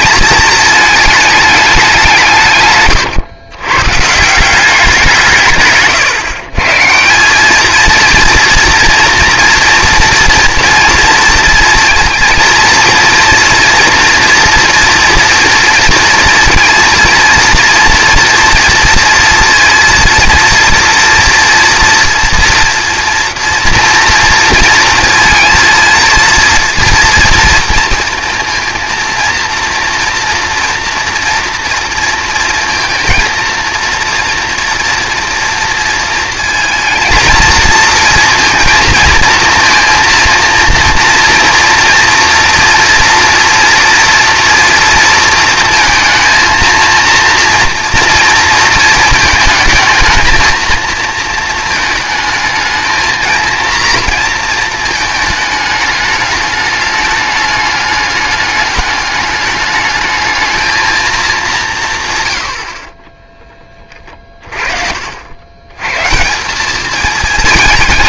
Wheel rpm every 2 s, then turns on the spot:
220, 130, 180, 140, 230, 230, 230, 230, 230, 240, 230, 230, 220, 230, 230, 240, 230, 230, 230, 230, 230, 240, 230, 230, 220, 220, 220, 230, 210, 210, 220, 60, 40, 200.
none